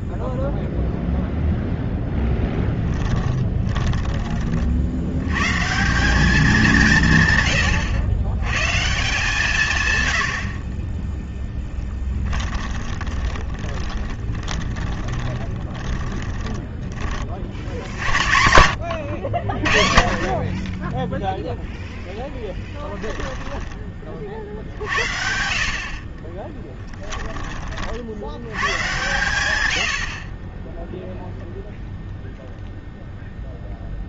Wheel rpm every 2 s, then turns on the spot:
0, 20, 60, 170, 140, 30, 30, 20, 10, 90, 20, 10, 60, 10, 120, 0, 0.
2-4 12-16 22-24 26-28